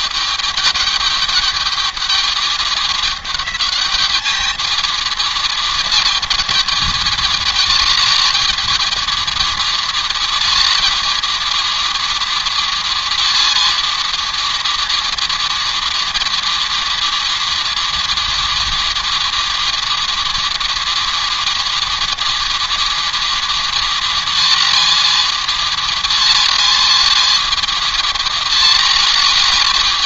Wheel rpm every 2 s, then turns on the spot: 210, 210, 220, 220, 220, 220, 230, 230, 230, 230, 230, 230, 230, 220, 230.
none